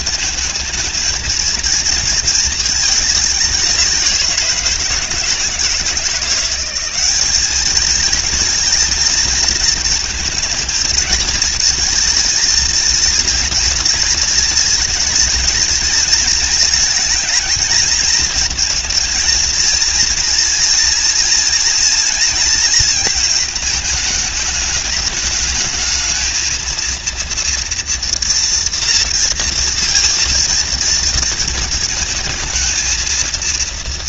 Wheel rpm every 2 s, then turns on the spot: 220, 210, 160, 200, 230, 220, 230, 230, 220, 230, 230, 220, 210, 230, 230, 220, 230.
none